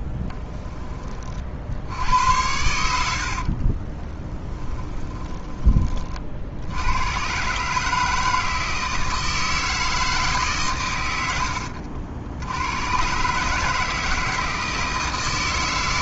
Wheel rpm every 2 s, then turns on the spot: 10, 80, 30, 70, 160, 120, 110, 160.
4-6